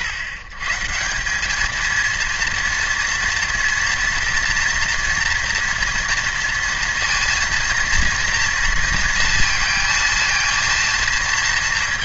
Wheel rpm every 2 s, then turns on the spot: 130, 230, 240, 230, 230, 230.
none